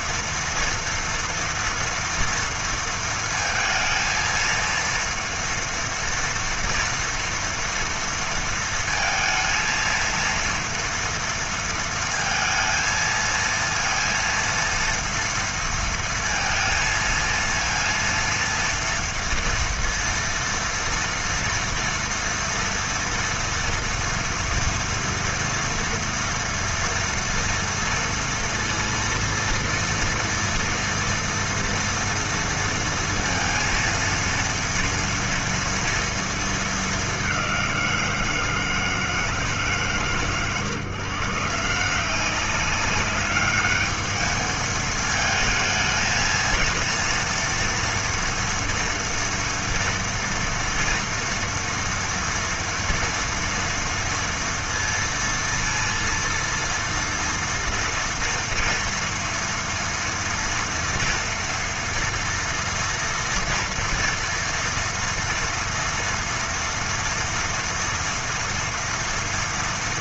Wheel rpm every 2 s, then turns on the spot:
230, 230, 230, 230, 230, 230, 230, 230, 230, 230, 230, 230, 230, 230, 230, 230, 230, 230, 220, 160, 130, 190, 220, 230, 240, 230, 230, 230, 230, 230, 230, 230, 230, 240, 230.
none